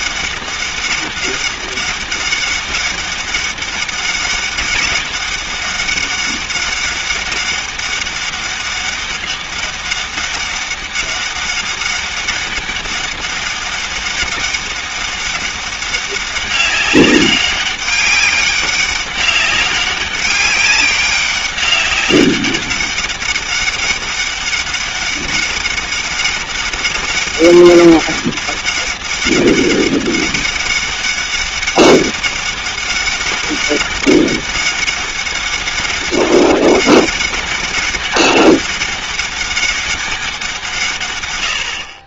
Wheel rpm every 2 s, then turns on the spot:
200, 200, 200, 200, 200, 200, 200, 200, 200, 200, 200, 200, 200, 200, 200, 200, 190, 200, 200, 200, 160.
none